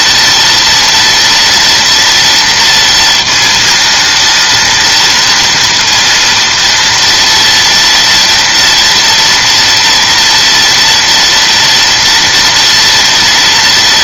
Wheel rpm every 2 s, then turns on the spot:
240, 230, 230, 230, 230, 230, 240.
none